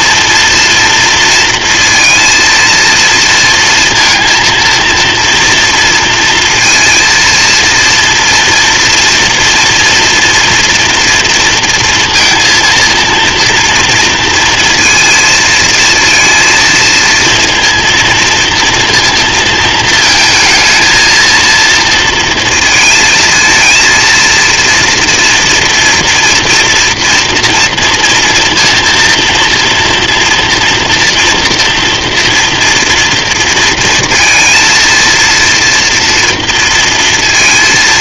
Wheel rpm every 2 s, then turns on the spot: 230, 230, 230, 230, 230, 230, 230, 220, 230, 230, 220, 230, 230, 240, 230, 230, 230, 230, 230.
none